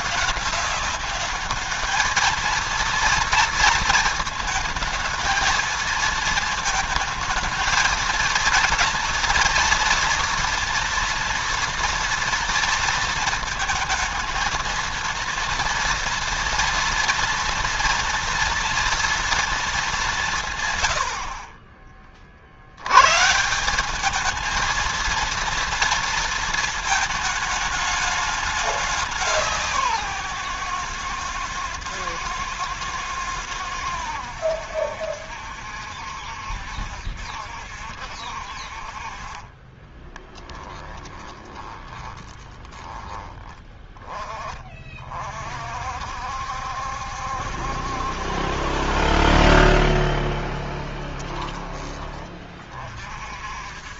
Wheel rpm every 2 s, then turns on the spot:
200, 230, 220, 220, 230, 230, 220, 230, 230, 240, 110, 100, 220, 220, 200, 120, 110, 70, 70, 50, 10, 20, 40, 70, 40, 30, 40.
40-42 50-52